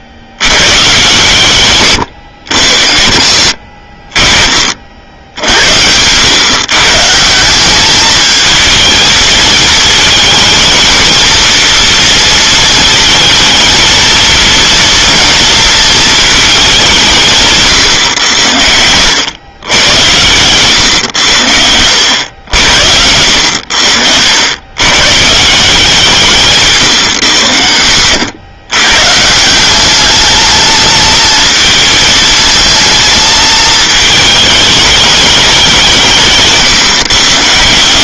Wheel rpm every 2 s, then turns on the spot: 110, 80, 50, 130, 220, 220, 230, 230, 200, 90, 120, 90, 100, 160, 110, 210, 220, 210, 150.
20-22